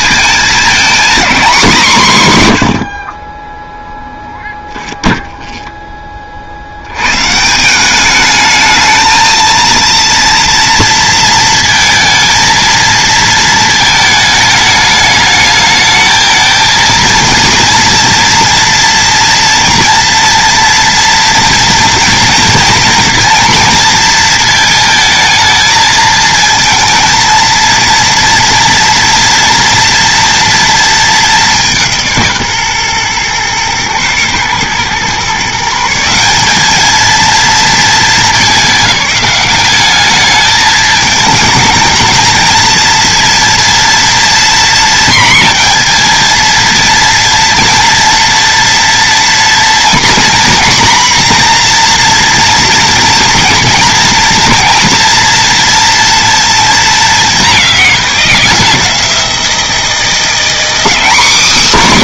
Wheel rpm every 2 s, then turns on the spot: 240, 40, 0, 120, 220, 230, 230, 210, 230, 230, 230, 230, 220, 230, 230, 220, 130, 130, 220, 200, 210, 230, 240, 230, 230, 240, 240, 240, 210, 170, 230.
none